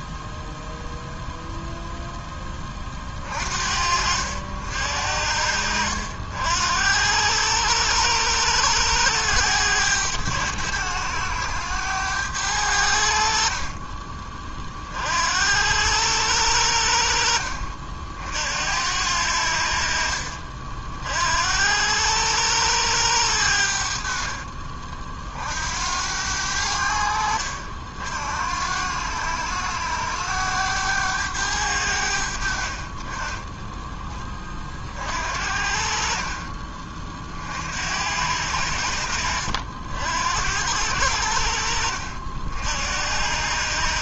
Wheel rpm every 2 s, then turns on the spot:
0, 20, 70, 70, 100, 100, 90, 40, 80, 70, 50, 100, 40, 80, 80, 100, 60, 30, 30, 80, 80, 60.
24-26 36-38